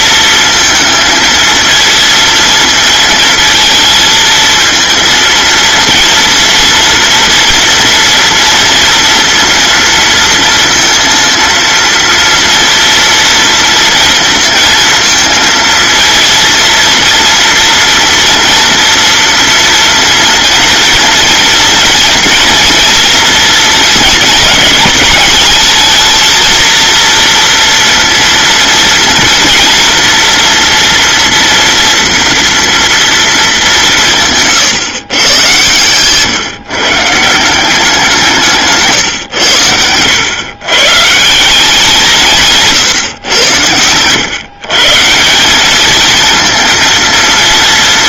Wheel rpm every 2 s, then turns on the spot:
230, 230, 230, 230, 230, 230, 230, 230, 230, 230, 230, 230, 220, 230, 230, 240, 230, 130, 150, 140, 140, 140, 150, 230.
none